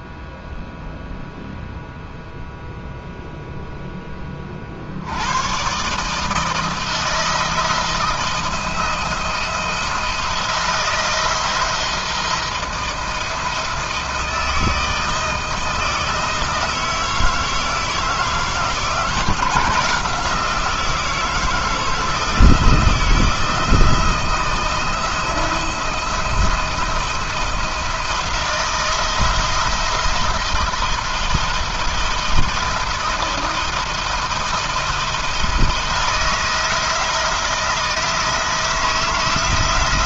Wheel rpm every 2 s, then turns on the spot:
0, 0, 50, 160, 170, 170, 170, 160, 170, 160, 170, 170, 170, 170, 170, 170, 160, 160, 160, 160.
none